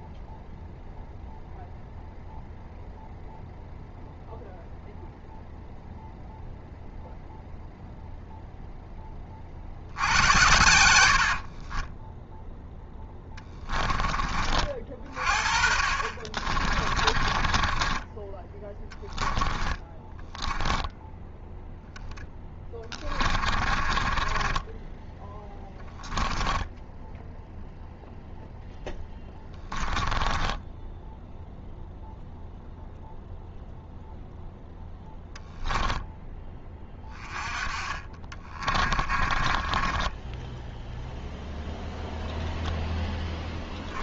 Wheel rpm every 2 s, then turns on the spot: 0, 0, 0, 0, 0, 90, 0, 40, 30, 10, 10, 20, 20, 10, 0, 10, 0, 0, 20, 30, 0, 10.
10-12 16-28 30-32 38-40 42-44